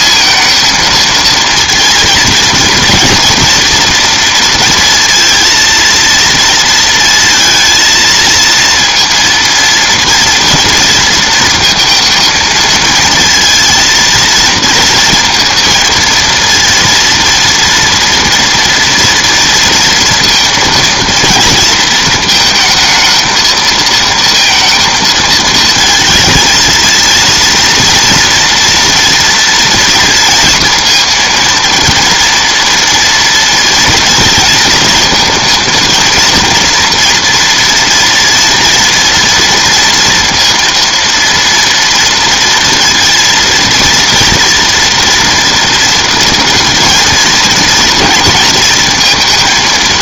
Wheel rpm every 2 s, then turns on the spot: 230, 230, 230, 220, 230, 230, 220, 230, 230, 230, 230, 220, 230, 230, 230, 230, 230, 230, 230, 230, 230, 230, 230, 230, 230.
none